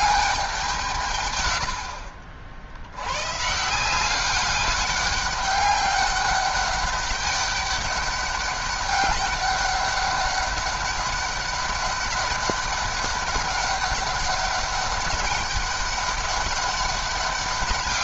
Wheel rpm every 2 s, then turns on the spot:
180, 80, 200, 200, 200, 200, 200, 200, 200.
none